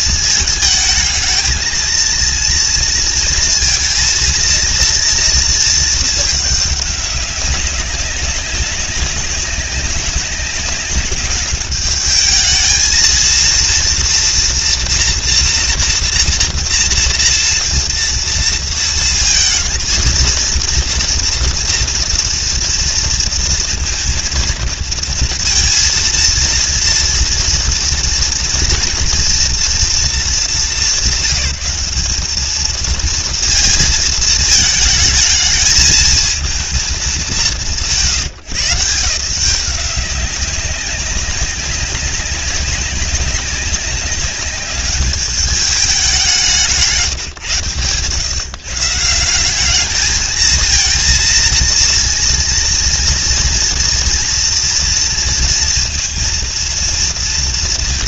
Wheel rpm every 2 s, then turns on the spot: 210, 230, 230, 200, 190, 190, 220, 230, 230, 230, 230, 230, 230, 230, 230, 200, 220, 220, 190, 130, 200, 190, 200, 160, 140, 220, 230, 230, 230.
none